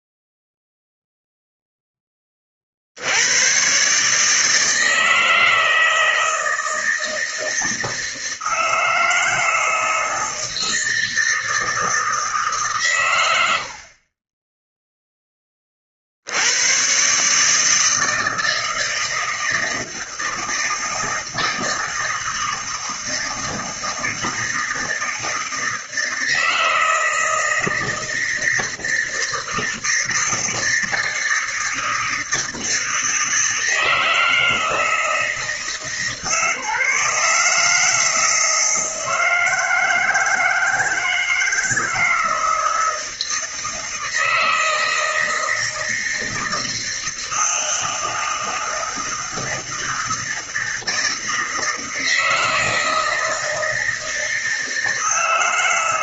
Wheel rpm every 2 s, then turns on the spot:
0, 30, 150, 160, 160, 160, 150, 10, 80, 160, 160, 160, 160, 160, 160, 160, 160, 160, 150, 160, 160, 160, 160, 160, 160, 160, 160, 160.
none